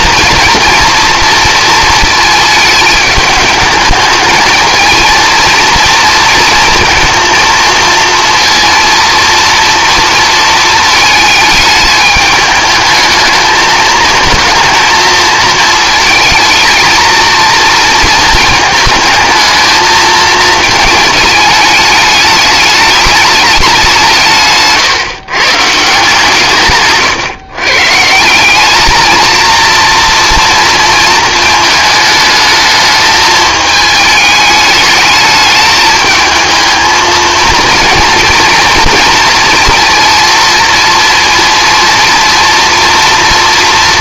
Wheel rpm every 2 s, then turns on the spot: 240, 210, 220, 230, 230, 220, 220, 220, 220, 220, 220, 210, 160, 130, 210, 230, 220, 210, 220, 230, 230, 240.
none